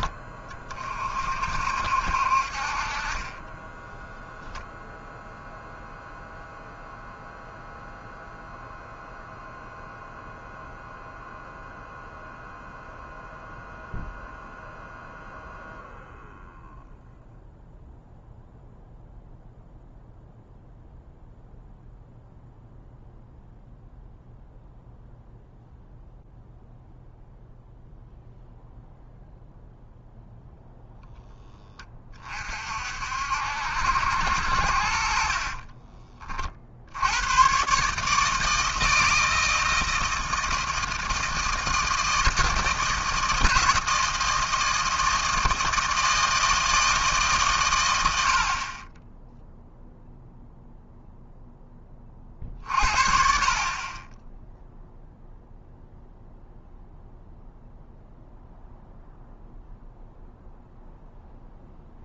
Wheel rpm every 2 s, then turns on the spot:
20, 60, 0, 0, 0, 0, 0, 0, 0, 0, 0, 0, 0, 0, 0, 0, 40, 70, 30, 150, 160, 160, 160, 160, 60, 0, 40, 0, 0, 0, 0.
none